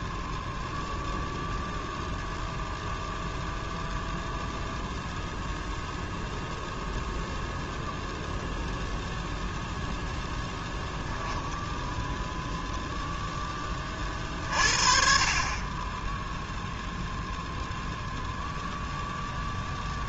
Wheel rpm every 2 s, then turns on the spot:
0, 0, 0, 0, 0, 10, 0, 40, 0, 0.
none